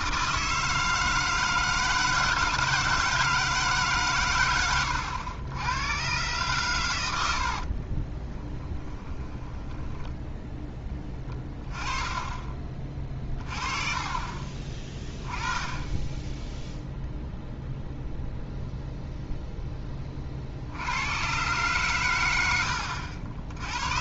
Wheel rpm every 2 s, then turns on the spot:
160, 160, 110, 110, 10, 10, 20, 30, 10, 0, 60, 90.
8-10